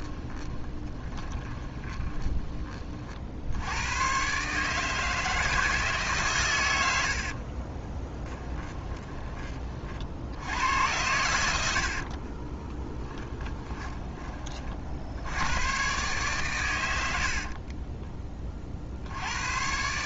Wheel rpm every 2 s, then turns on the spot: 20, 40, 150, 100, 10, 90, 20, 50, 100, 60.
0-2 8-14